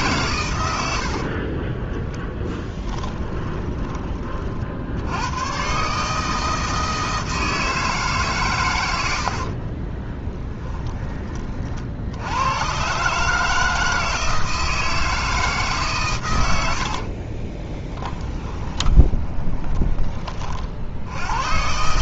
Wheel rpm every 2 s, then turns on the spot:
80, 10, 60, 160, 100, 20, 120, 160, 80, 20, 60.
0-4 8-12 16-20